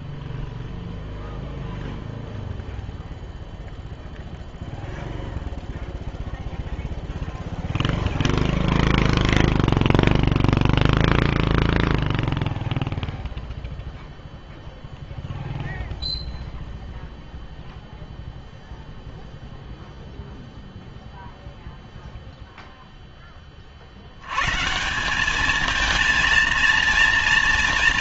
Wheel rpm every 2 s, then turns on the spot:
0, 0, 0, 0, 0, 0, 0, 0, 0, 0, 0, 0, 110, 230.
none